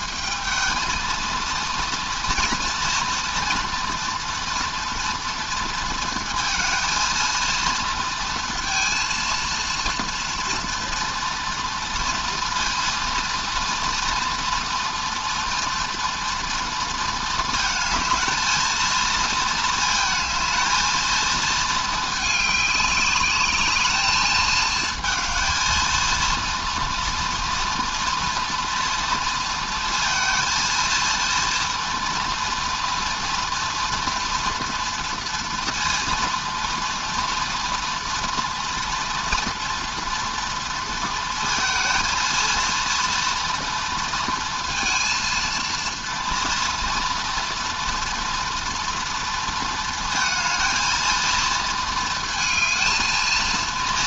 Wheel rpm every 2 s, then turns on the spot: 220, 230, 230, 220, 230, 230, 230, 230, 230, 230, 220, 210, 230, 230, 230, 230, 230, 230, 230, 240, 230, 230, 230, 230, 230, 230, 220.
none